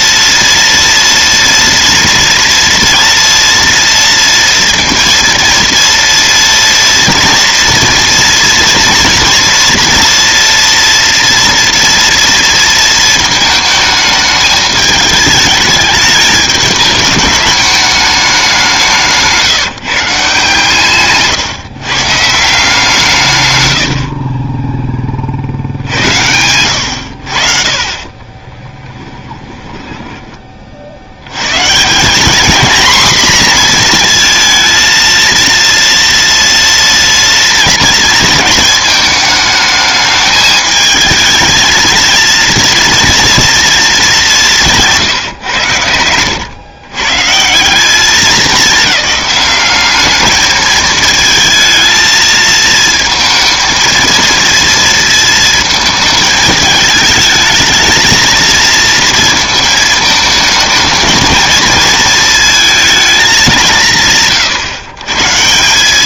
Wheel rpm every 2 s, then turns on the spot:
230, 230, 230, 230, 230, 230, 230, 210, 210, 190, 140, 160, 20, 90, 30, 40, 230, 230, 230, 220, 220, 230, 170, 120, 210, 220, 220, 230, 220, 230, 220, 230, 130.
26-30 44-46